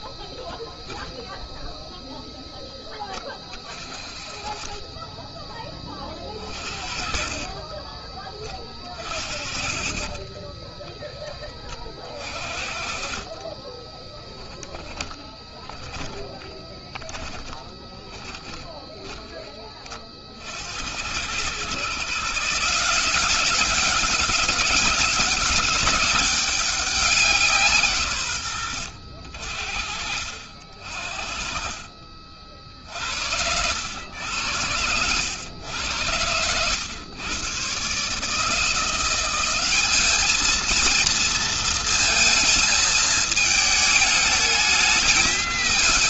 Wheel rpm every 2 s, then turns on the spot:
10, 20, 20, 40, 40, 10, 40, 10, 20, 10, 90, 180, 190, 180, 70, 50, 60, 100, 110, 180, 230, 220, 210.
6-10 12-18